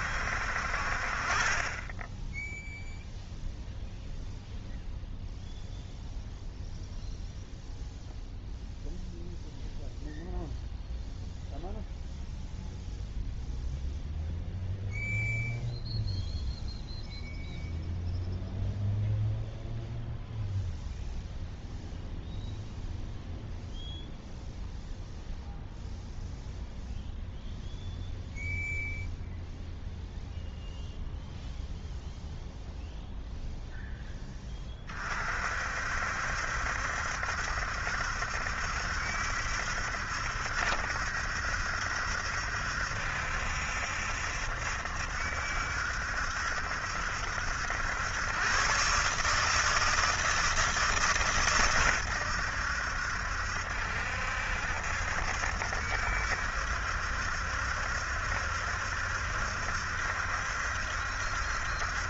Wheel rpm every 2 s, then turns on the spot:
50, 0, 0, 0, 0, 0, 0, 0, 0, 0, 0, 0, 0, 0, 0, 0, 0, 30, 70, 70, 70, 70, 70, 70, 130, 160, 80, 70, 70, 70, 70.
none